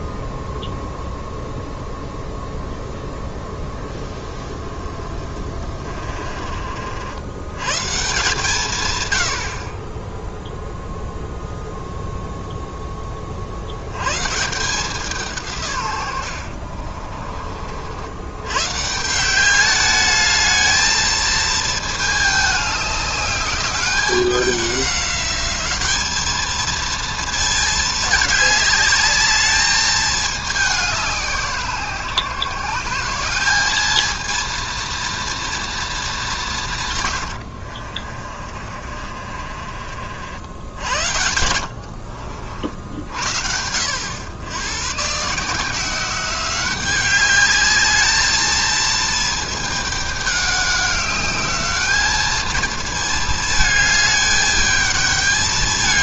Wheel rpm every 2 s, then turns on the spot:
0, 0, 20, 50, 140, 0, 10, 170, 60, 130, 220, 210, 200, 220, 210, 200, 160, 230, 170, 40, 70, 60, 110, 190, 220, 200, 220, 220.
16-18 38-40